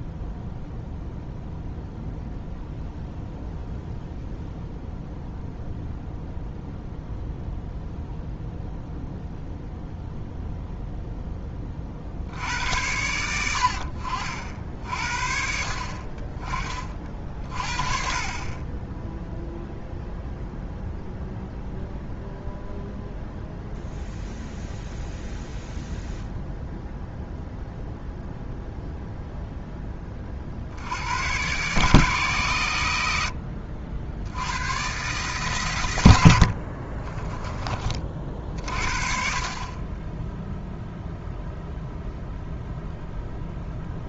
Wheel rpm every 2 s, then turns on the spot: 0, 0, 0, 0, 0, 0, 90, 50, 40, 10, 0, 0, 0, 0, 0, 90, 90, 130, 30, 40, 0, 0.
36-38